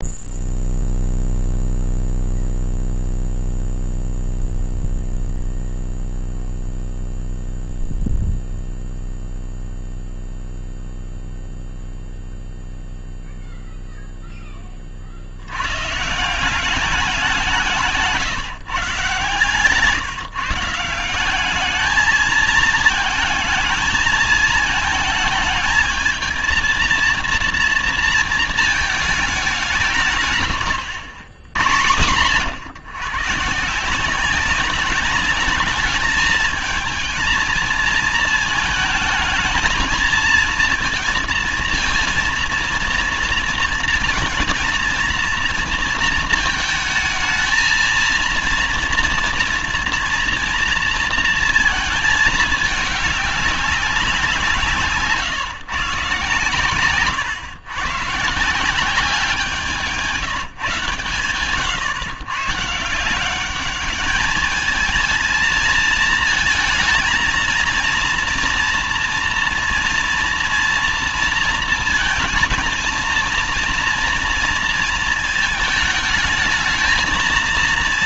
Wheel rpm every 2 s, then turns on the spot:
0, 0, 0, 0, 0, 0, 0, 20, 180, 140, 160, 220, 220, 230, 220, 140, 130, 190, 220, 220, 220, 230, 230, 220, 230, 230, 210, 160, 130, 170, 160, 140, 210, 230, 240, 230, 230, 230, 220.
none